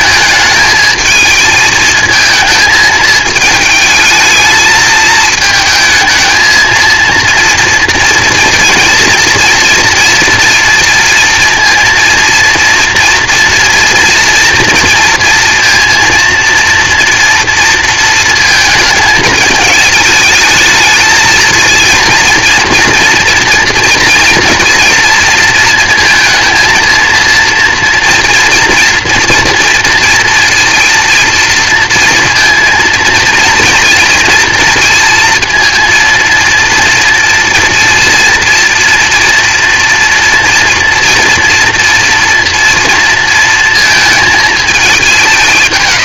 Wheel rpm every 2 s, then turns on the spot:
220, 220, 220, 230, 230, 230, 230, 230, 230, 220, 220, 230, 230, 230, 230, 230, 230, 230, 230, 230, 230, 230, 210.
none